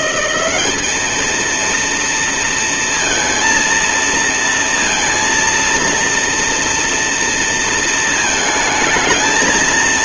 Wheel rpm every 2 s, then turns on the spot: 210, 230, 230, 230, 220.
none